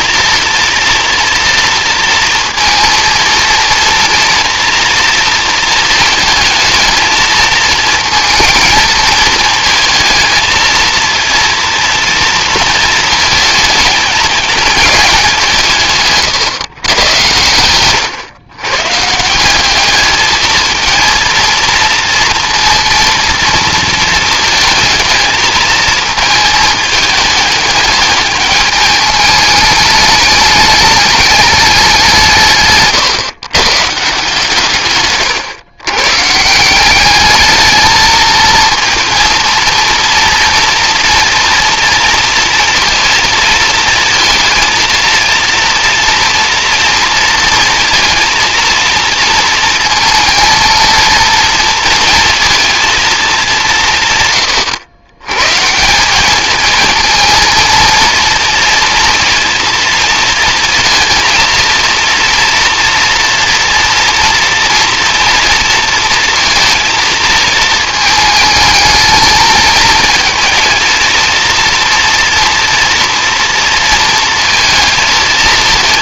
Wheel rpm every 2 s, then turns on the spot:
230, 230, 230, 220, 220, 230, 230, 210, 120, 130, 230, 230, 220, 210, 210, 210, 140, 140, 180, 230, 230, 230, 230, 230, 230, 230, 230, 120, 220, 230, 230, 230, 230, 230, 220, 220, 240, 230.
34-36